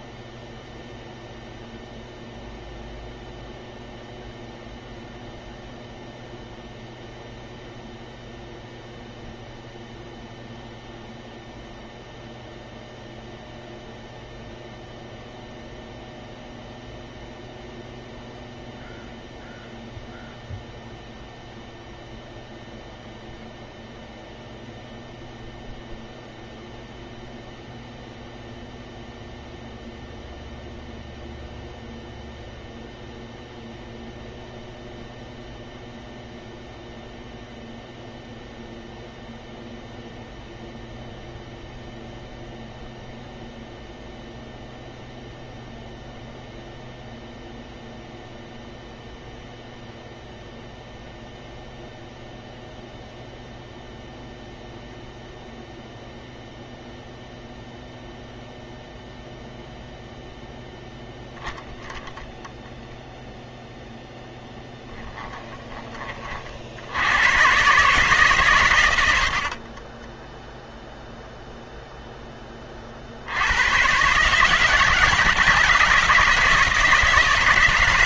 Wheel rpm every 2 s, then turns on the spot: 0, 0, 0, 0, 0, 0, 0, 0, 0, 0, 0, 0, 0, 0, 0, 0, 0, 0, 0, 0, 0, 0, 0, 0, 0, 0, 0, 0, 0, 0, 0, 0, 10, 60, 110, 0, 30, 150, 170.
64-66